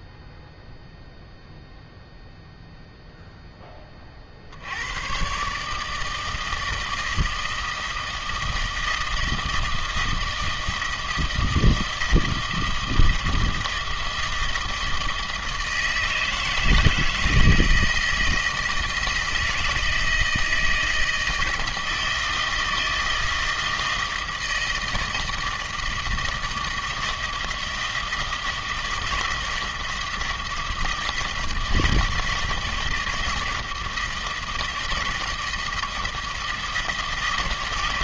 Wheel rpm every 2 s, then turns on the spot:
0, 0, 80, 160, 160, 160, 160, 160, 160, 160, 160, 160, 160, 160, 160, 160, 160, 160, 160.
none